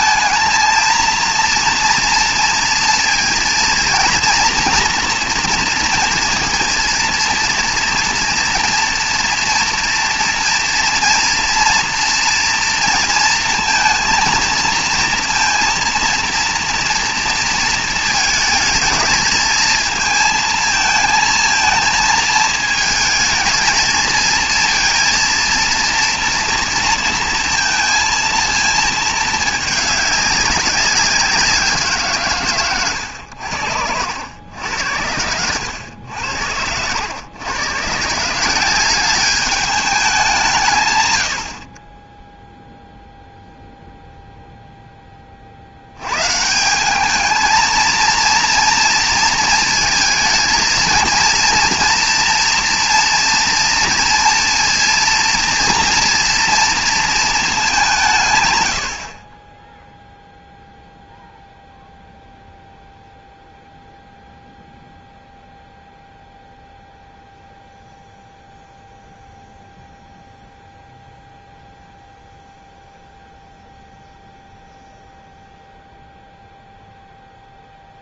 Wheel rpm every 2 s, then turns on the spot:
230, 230, 240, 230, 230, 230, 230, 230, 230, 220, 230, 220, 230, 230, 230, 200, 140, 90, 80, 180, 160, 0, 0, 160, 230, 220, 230, 230, 230, 110, 0, 0, 0, 0, 0, 0, 0, 0, 0.
none